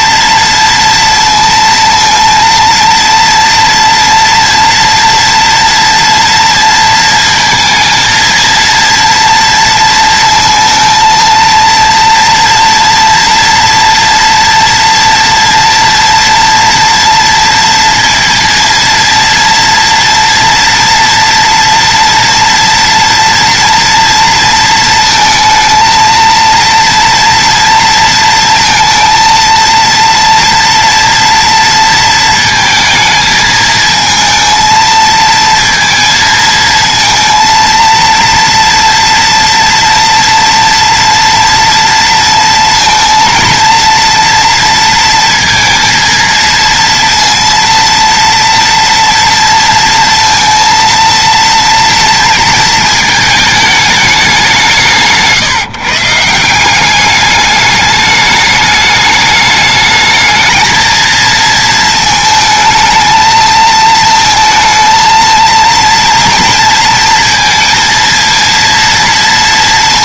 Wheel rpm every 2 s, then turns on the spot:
230, 230, 230, 230, 230, 220, 230, 230, 230, 230, 230, 230, 230, 230, 230, 230, 220, 220, 230, 230, 230, 230, 230, 230, 230, 230, 230, 170, 180, 210, 220, 220, 230, 230, 230.
none